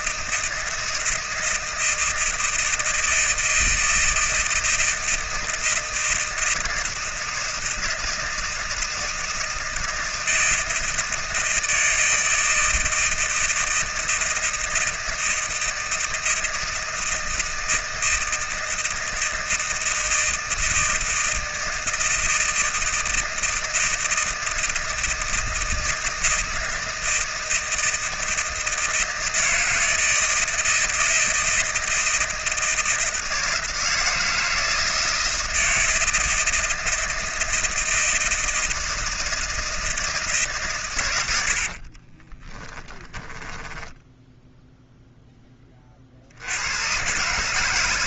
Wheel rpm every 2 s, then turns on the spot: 160, 160, 160, 160, 160, 160, 160, 160, 160, 160, 160, 160, 160, 160, 160, 160, 160, 160, 160, 160, 130, 10, 0, 90.
42-44